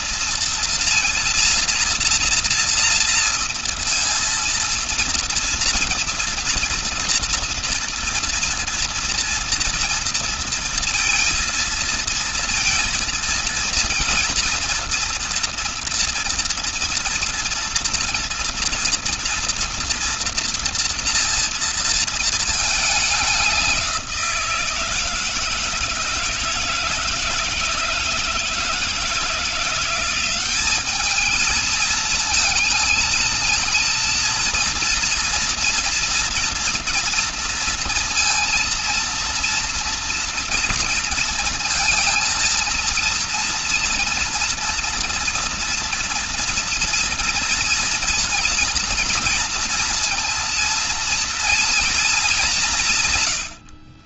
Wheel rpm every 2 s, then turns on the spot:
230, 230, 230, 230, 230, 230, 230, 230, 230, 230, 230, 220, 170, 160, 160, 200, 220, 230, 230, 230, 230, 230, 230, 230, 230, 230, 170.
none